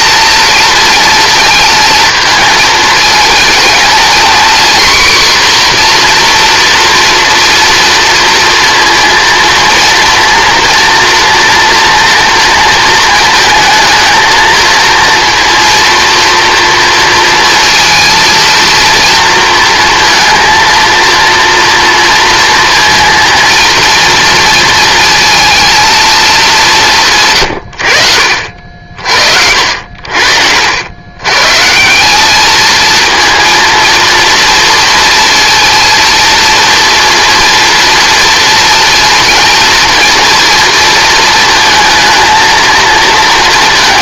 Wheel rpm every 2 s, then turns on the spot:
230, 220, 250, 240, 230, 240, 230, 230, 230, 230, 230, 230, 230, 200, 60, 80, 220, 240, 230, 230, 230, 230.
none